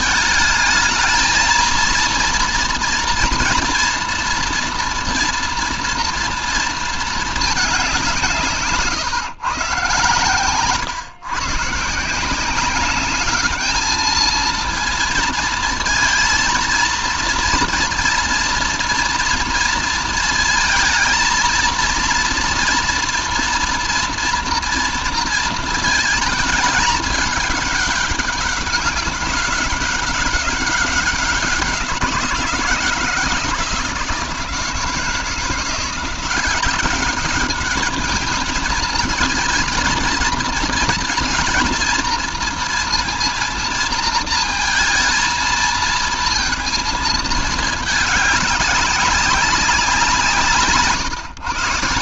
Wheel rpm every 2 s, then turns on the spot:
220, 230, 230, 230, 150, 120, 190, 230, 230, 230, 220, 230, 230, 220, 200, 200, 170, 170, 190, 220, 220, 230, 220, 230, 200, 150.
8-10